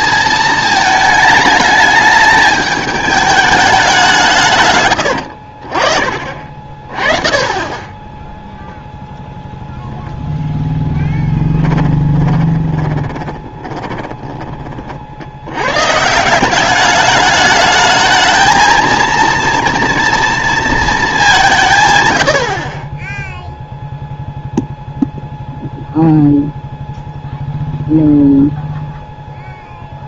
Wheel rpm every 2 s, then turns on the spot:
220, 210, 120, 30, 0, 0, 30, 40, 200, 230, 230, 30, 0, 0, 0.
4-6 12-14